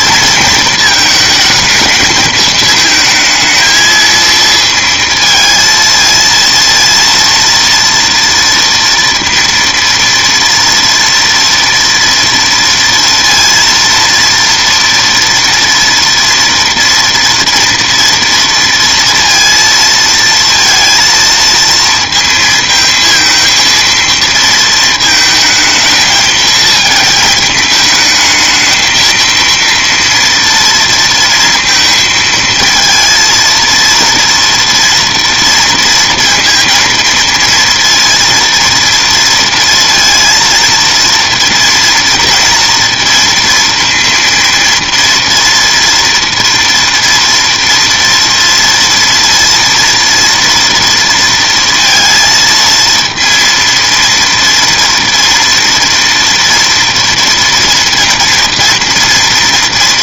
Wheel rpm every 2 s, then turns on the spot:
230, 220, 230, 230, 230, 230, 230, 230, 230, 230, 230, 220, 230, 220, 220, 230, 220, 230, 230, 230, 230, 230, 230, 230, 230, 230, 230, 230, 230, 240.
none